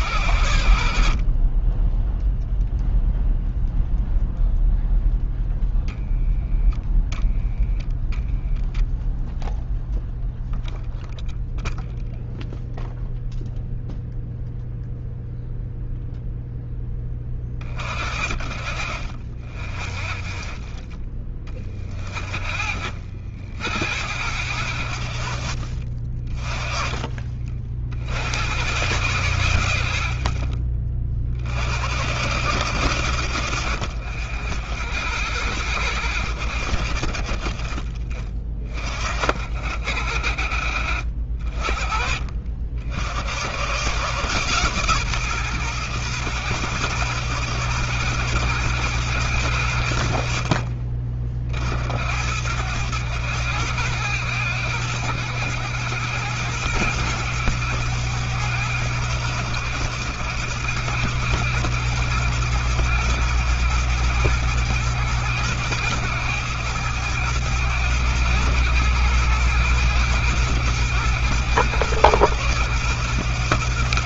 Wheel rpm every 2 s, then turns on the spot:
20, 0, 0, 0, 0, 0, 0, 0, 40, 30, 50, 60, 40, 60, 60, 60, 80, 80, 30, 40, 40, 100, 120, 120, 90, 60, 100, 100, 100, 110, 110, 110, 110, 110, 110, 110, 110.
none